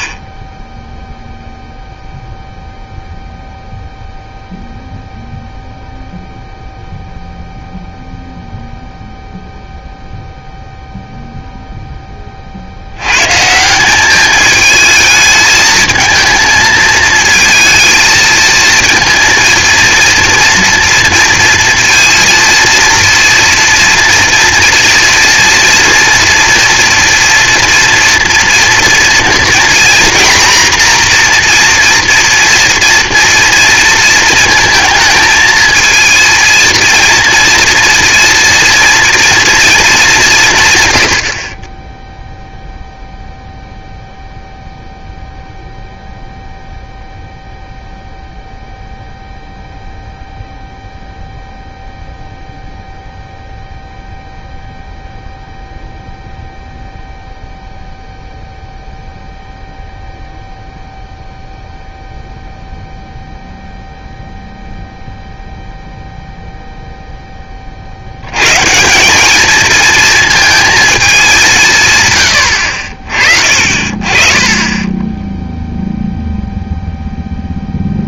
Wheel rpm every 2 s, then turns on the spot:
10, 0, 0, 0, 0, 0, 40, 220, 230, 220, 230, 230, 240, 240, 230, 240, 240, 220, 230, 230, 160, 0, 0, 0, 0, 0, 0, 0, 0, 0, 0, 0, 0, 0, 130, 230, 70, 20, 0.
none